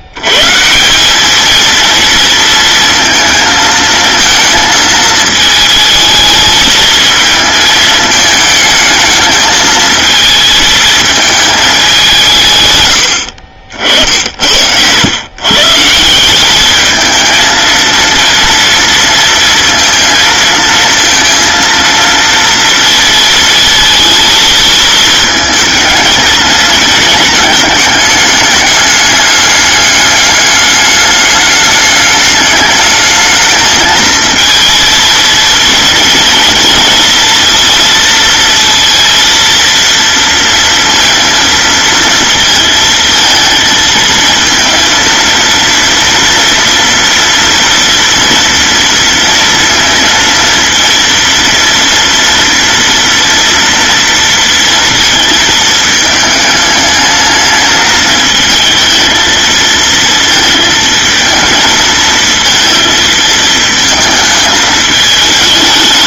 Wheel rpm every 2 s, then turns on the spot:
120, 230, 220, 220, 220, 220, 140, 80, 190, 230, 230, 230, 220, 220, 210, 210, 210, 230, 230, 230, 230, 230, 230, 230, 230, 230, 230, 230, 210, 220, 220, 220, 220.
none